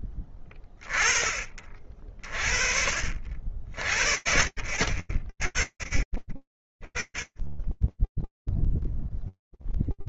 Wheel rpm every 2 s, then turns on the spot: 30, 70, 60, 20, 0.
none